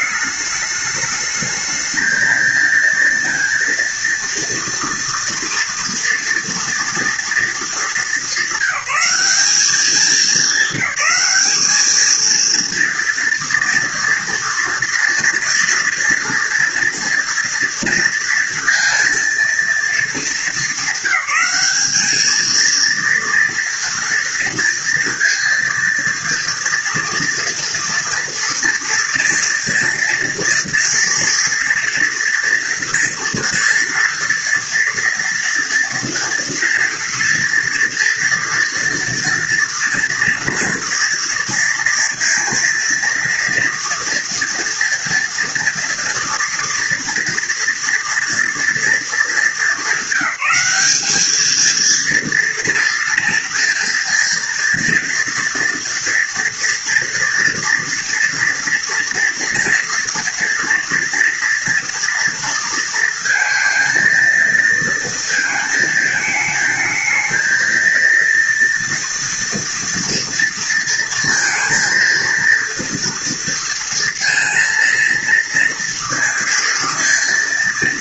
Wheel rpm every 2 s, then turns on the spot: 210, 230, 230, 240, 200, 210, 230, 230, 230, 230, 200, 230, 230, 230, 230, 230, 230, 230, 230, 230, 230, 230, 230, 230, 230, 200, 230, 230, 230, 230, 230, 220, 230, 220, 230, 230, 230, 230, 230.
none